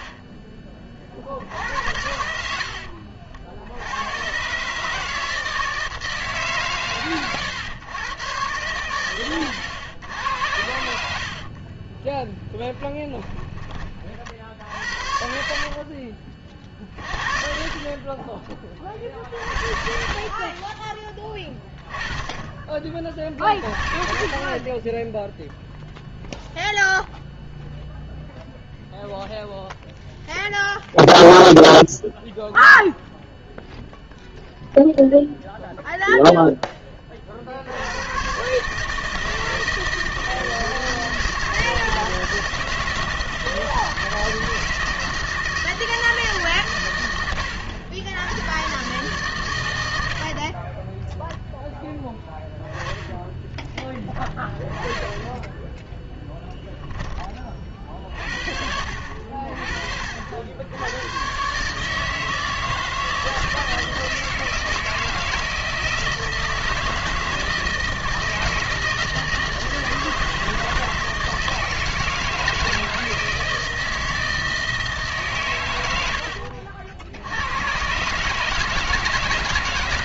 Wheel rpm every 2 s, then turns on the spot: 20, 60, 140, 140, 110, 80, 10, 70, 40, 30, 30, 30, 40, 0, 0, 0, 0, 0, 10, 140, 160, 160, 160, 130, 110, 40, 10, 20, 10, 60, 70, 160, 160, 160, 160, 160, 160, 160, 60, 150.
12-14 50-56